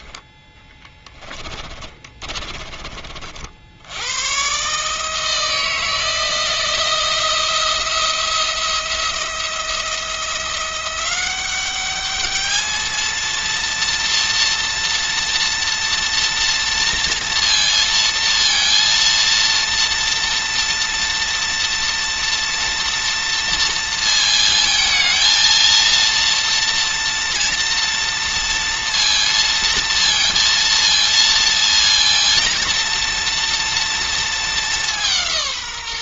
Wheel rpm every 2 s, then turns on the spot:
10, 30, 140, 170, 170, 180, 220, 230, 230, 230, 230, 230, 230, 230, 230, 230, 230, 200.
0-4